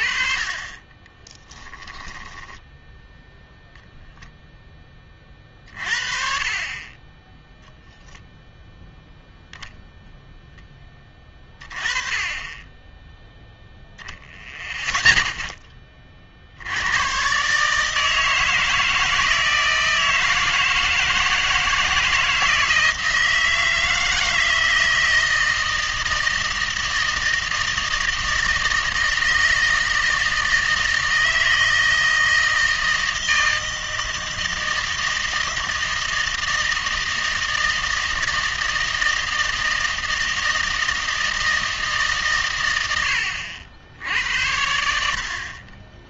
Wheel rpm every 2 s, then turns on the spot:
20, 10, 10, 30, 0, 10, 10, 30, 80, 160, 160, 160, 160, 160, 160, 160, 160, 160, 160, 160, 160, 110, 80.
none